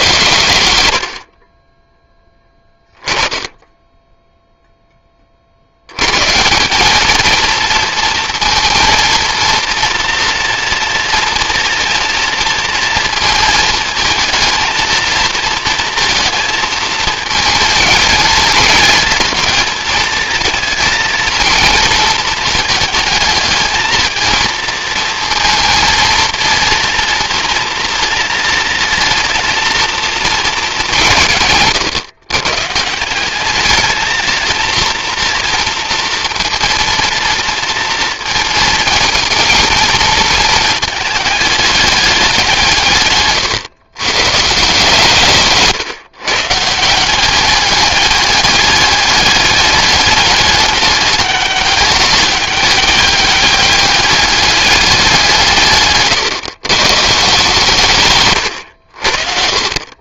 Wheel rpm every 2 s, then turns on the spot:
90, 10, 10, 190, 230, 230, 230, 230, 230, 230, 230, 220, 230, 230, 230, 200, 160, 230, 230, 230, 220, 160, 150, 170, 210, 210, 200, 200, 140, 80.
none